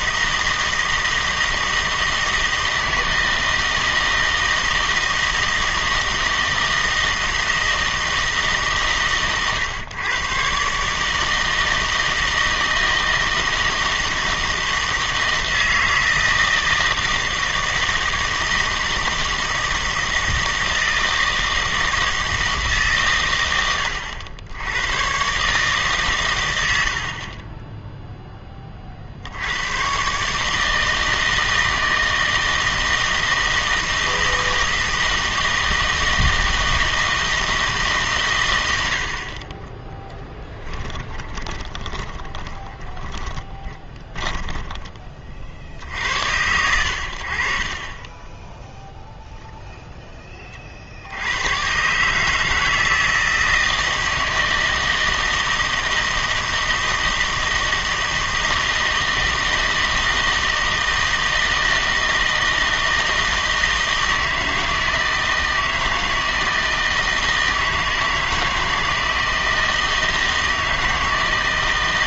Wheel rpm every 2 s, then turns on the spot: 160, 160, 160, 160, 140, 140, 160, 160, 160, 160, 160, 140, 100, 90, 30, 160, 160, 160, 160, 80, 10, 30, 20, 80, 0, 50, 160, 160, 160, 160, 160, 160, 160, 160, 160, 160.
40-46